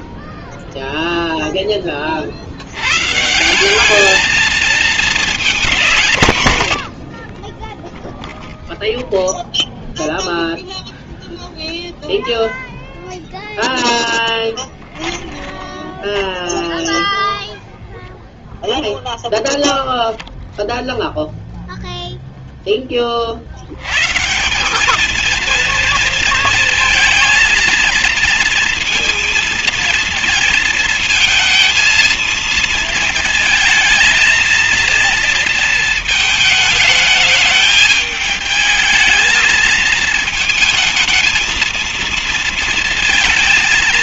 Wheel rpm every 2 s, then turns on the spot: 0, 90, 220, 140, 0, 0, 0, 10, 0, 0, 0, 10, 170, 230, 230, 230, 230, 230, 220, 220, 220, 230.
14-16